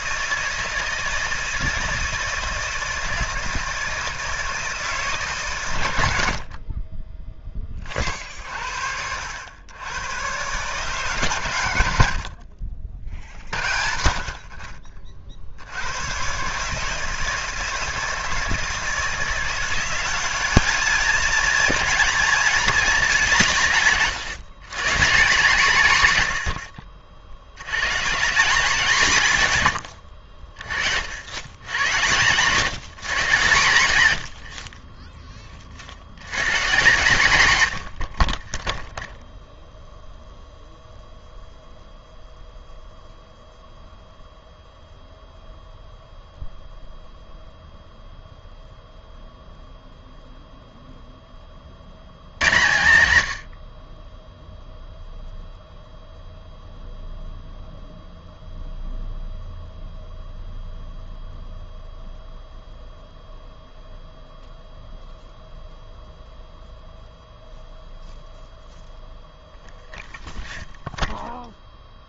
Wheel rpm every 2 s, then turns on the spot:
160, 160, 160, 50, 60, 130, 50, 50, 140, 160, 210, 220, 150, 90, 190, 50, 160, 50, 120, 20, 0, 0, 0, 0, 0, 0, 110, 0, 0, 0, 0, 0, 0, 0, 0, 0.
none